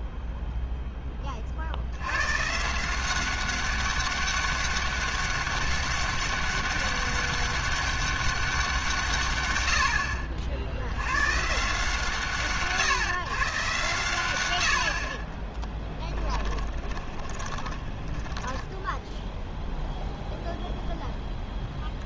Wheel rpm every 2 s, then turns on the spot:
80, 190, 200, 200, 60, 140, 120, 10, 20, 0, 0.
14-18